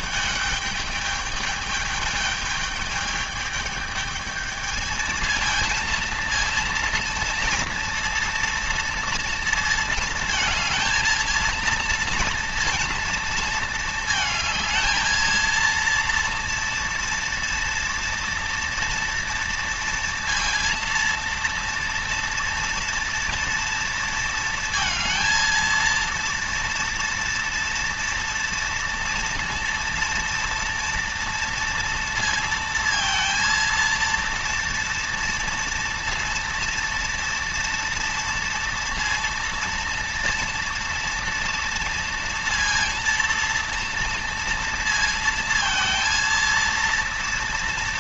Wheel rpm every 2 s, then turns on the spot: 210, 210, 220, 230, 230, 230, 230, 230, 230, 240, 230, 230, 220, 230, 230, 230, 230, 230, 230, 230, 230, 230, 230, 230.
none